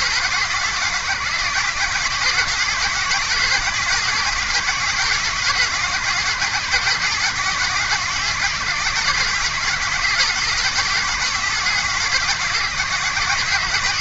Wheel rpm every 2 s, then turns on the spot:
130, 140, 140, 140, 130, 130, 130.
none